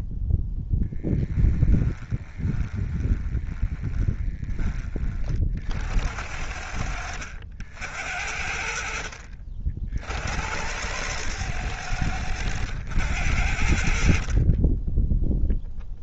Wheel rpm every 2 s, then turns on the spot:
20, 20, 30, 80, 60, 100, 90, 10.
0-4 6-8